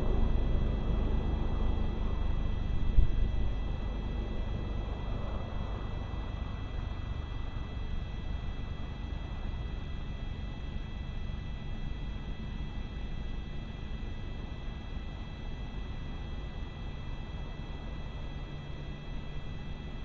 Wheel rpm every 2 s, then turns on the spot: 0, 0, 0, 0, 0, 0, 0, 0, 0, 0.
none